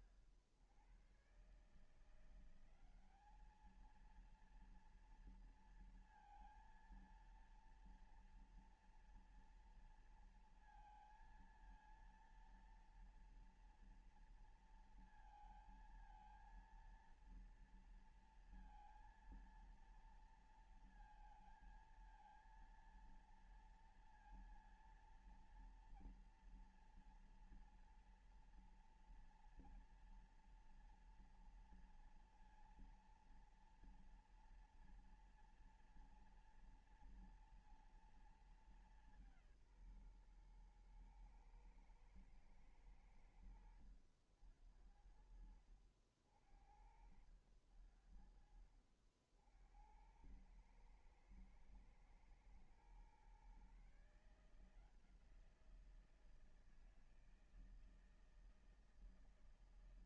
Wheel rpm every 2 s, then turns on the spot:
100, 170, 230, 230, 230, 230, 230, 230, 230, 230, 230, 230, 230, 230, 240, 230, 230, 230, 230, 220, 130, 110, 70, 70, 70, 90, 120, 160, 170, 160.
48-50